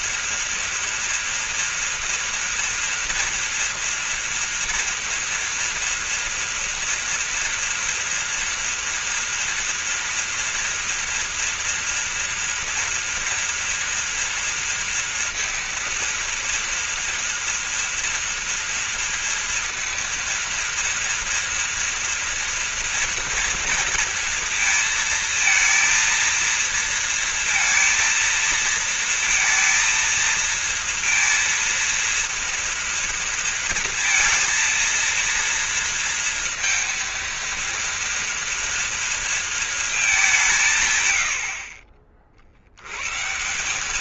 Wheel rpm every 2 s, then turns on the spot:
230, 230, 240, 230, 230, 230, 230, 230, 230, 230, 230, 230, 230, 230, 230, 230, 230, 230, 230, 230, 140, 80.
none